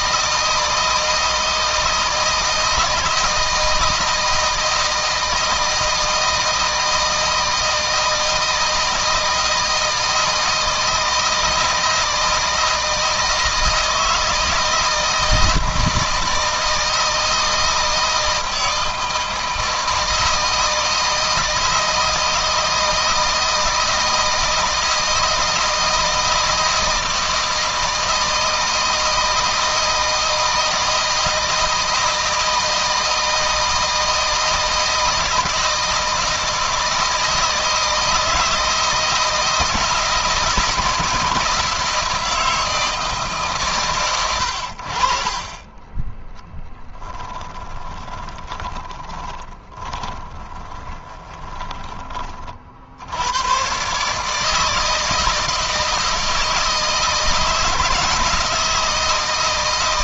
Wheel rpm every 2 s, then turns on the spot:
160, 160, 160, 160, 160, 160, 160, 160, 160, 160, 160, 160, 160, 160, 160, 160, 160, 160, 160, 170, 160, 160, 60, 10, 20, 20, 80, 160, 160, 160.
46-52